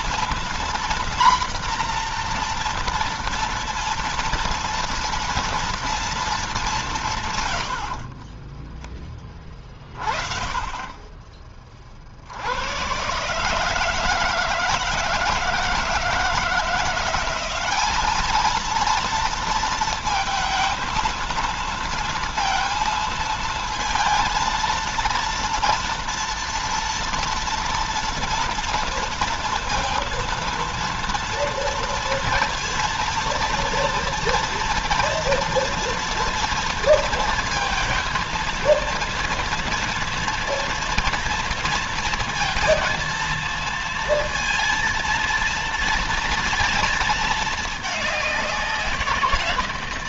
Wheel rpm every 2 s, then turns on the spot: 240, 230, 230, 180, 10, 20, 120, 160, 180, 230, 230, 230, 230, 230, 230, 230, 230, 230, 230, 230, 230, 230, 230, 220, 170.
none